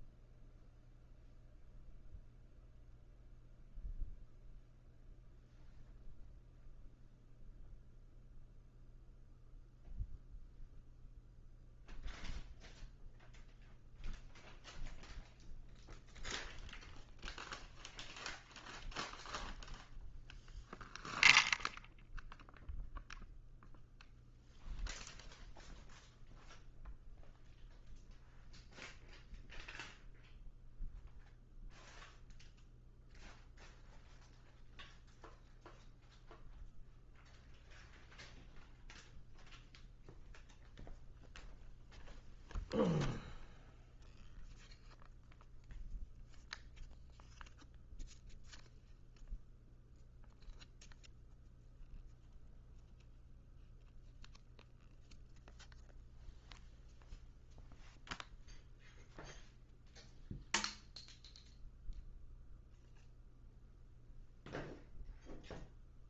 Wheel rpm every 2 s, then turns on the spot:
0, 0, 0, 0, 0, 0, 0, 0, 0, 0, 0, 0, 0, 0, 0, 0, 0, 0, 0, 0, 0, 0, 0, 0, 0, 0, 0, 0, 0, 0, 0, 0, 0.
none